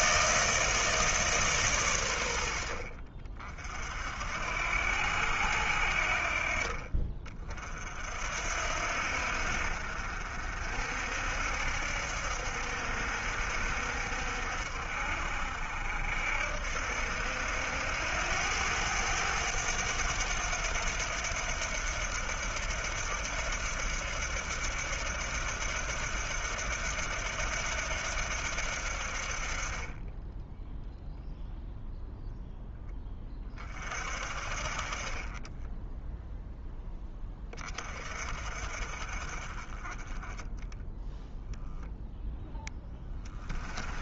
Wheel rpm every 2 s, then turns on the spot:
160, 60, 80, 50, 70, 60, 70, 60, 70, 100, 90, 70, 70, 80, 70, 0, 10, 40, 10, 40, 10, 10.
40-42